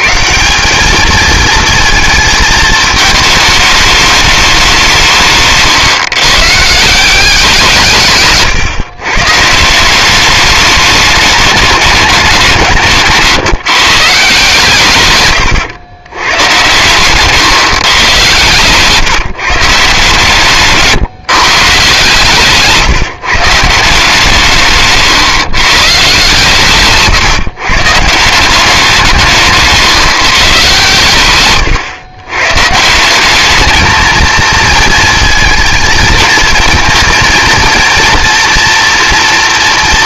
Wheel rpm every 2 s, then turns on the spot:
200, 220, 180, 170, 120, 210, 160, 140, 120, 150, 150, 150, 150, 150, 180, 140, 150, 230, 230, 240.
20-22